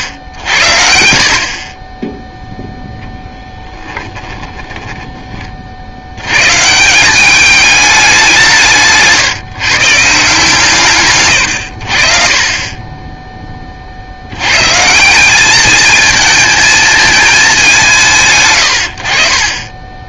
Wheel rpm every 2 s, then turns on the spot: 80, 0, 10, 180, 160, 140, 30, 120, 220, 60.
4-6 10-12